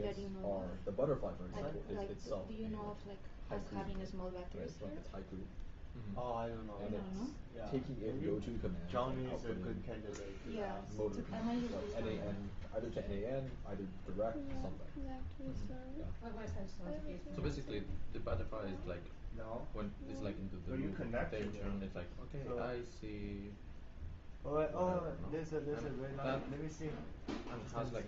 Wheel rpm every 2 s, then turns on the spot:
0, 0, 0, 0, 0, 0, 0, 0, 0, 0, 0, 0, 0, 0.
none